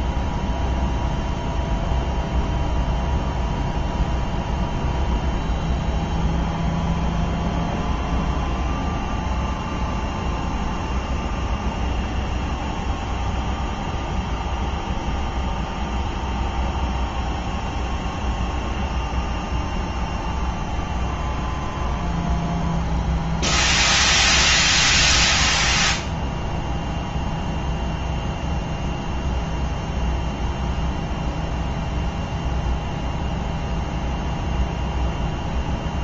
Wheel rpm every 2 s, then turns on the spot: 0, 0, 0, 0, 0, 0, 0, 0, 0, 0, 0, 0, 0, 0, 0, 0, 0, 0.
none